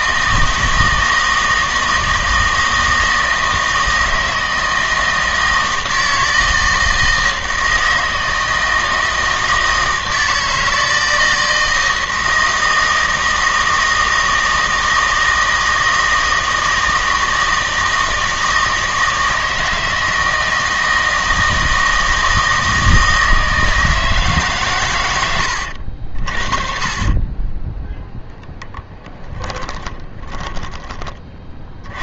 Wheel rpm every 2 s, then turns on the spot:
160, 160, 160, 160, 160, 160, 160, 160, 160, 160, 160, 160, 130, 50, 0, 20.
30-32